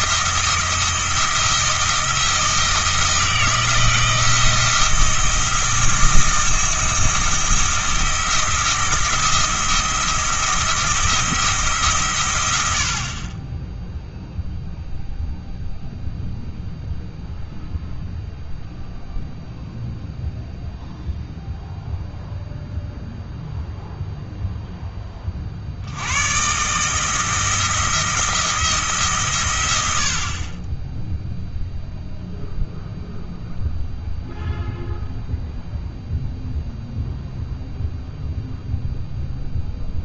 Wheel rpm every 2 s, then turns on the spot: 160, 160, 170, 170, 170, 170, 80, 0, 0, 0, 0, 0, 10, 140, 160, 10, 0, 0, 0, 0.
none